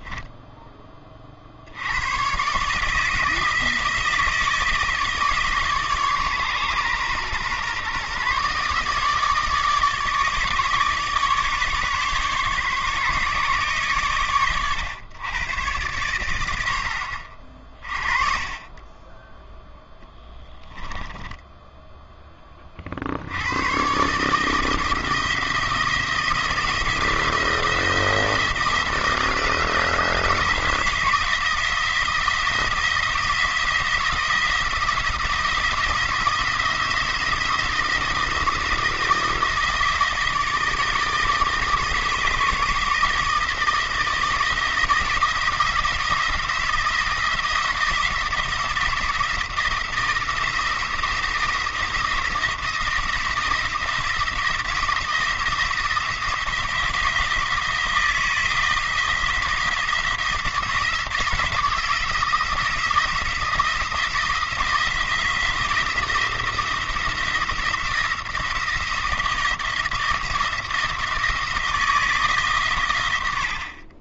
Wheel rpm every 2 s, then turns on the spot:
20, 150, 160, 120, 150, 150, 140, 110, 70, 20, 10, 50, 160, 170, 170, 170, 170, 170, 170, 170, 160, 160, 170, 170, 170, 170, 170, 170, 170, 170, 170, 160, 160, 170, 170, 160, 110.
20-22